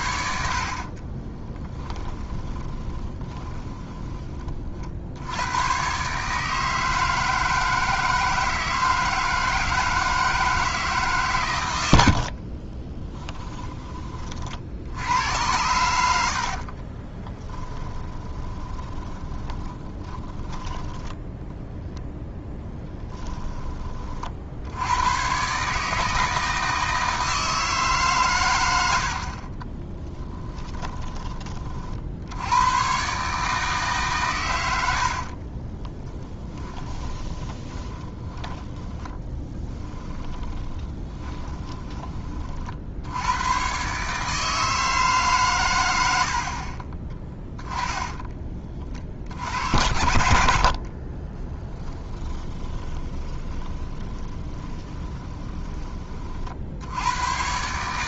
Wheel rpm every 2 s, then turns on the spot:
40, 20, 50, 160, 160, 160, 30, 70, 40, 20, 20, 10, 90, 160, 80, 30, 120, 80, 10, 20, 20, 70, 160, 30, 40, 40, 20, 20, 80.
0-4 12-14 16-24 30-32 34-42 50-56